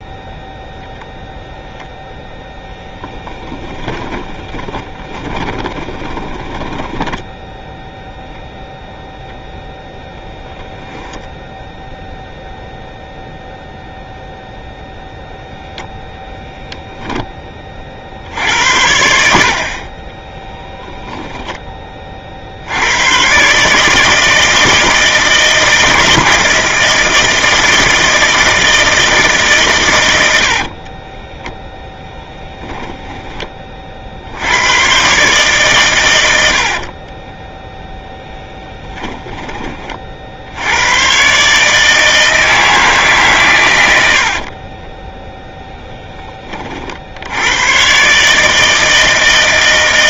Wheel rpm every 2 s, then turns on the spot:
0, 0, 10, 10, 10, 10, 10, 0, 0, 20, 60, 10, 140, 160, 160, 150, 10, 30, 140, 20, 20, 140, 110, 10, 110.
4-10 12-14 32-34 38-40